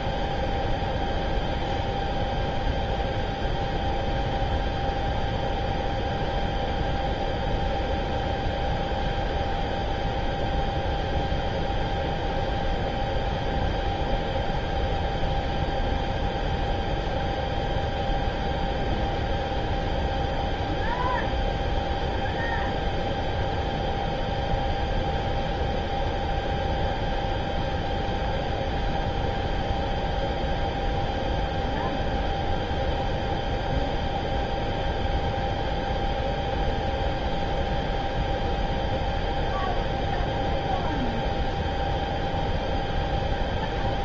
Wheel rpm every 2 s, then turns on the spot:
0, 0, 0, 0, 0, 0, 0, 0, 0, 0, 0, 0, 0, 0, 0, 0, 0, 0, 0, 0, 0, 0.
none